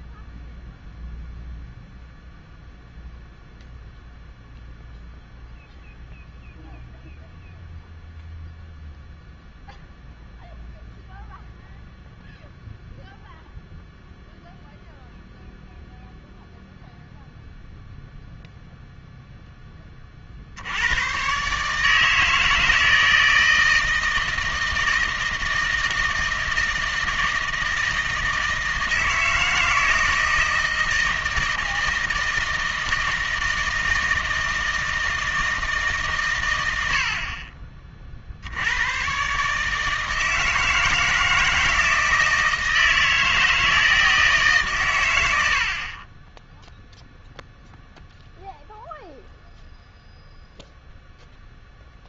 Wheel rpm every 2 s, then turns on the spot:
0, 0, 0, 0, 0, 0, 0, 0, 0, 0, 90, 160, 160, 160, 160, 160, 160, 160, 80, 110, 160, 160, 120, 0, 0, 0.
none